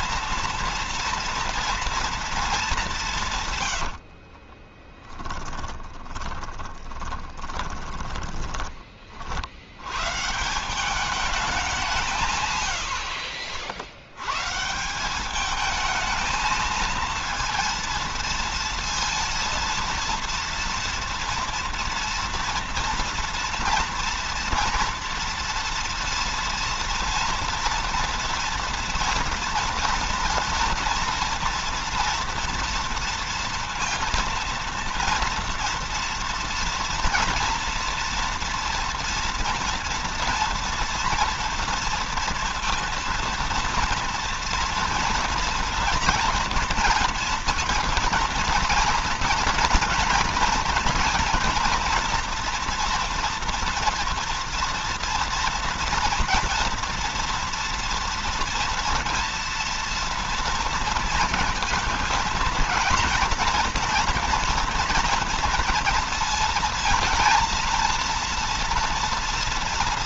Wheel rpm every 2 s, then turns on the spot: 230, 200, 20, 20, 20, 190, 110, 170, 230, 230, 230, 230, 230, 230, 230, 230, 230, 230, 240, 230, 230, 230, 230, 240, 230, 230, 240, 230, 230, 230, 230, 230, 230, 230, 230.
4-8